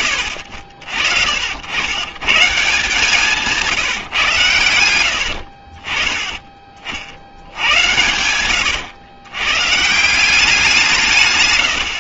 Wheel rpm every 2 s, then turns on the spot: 70, 150, 100, 50, 100, 170.
none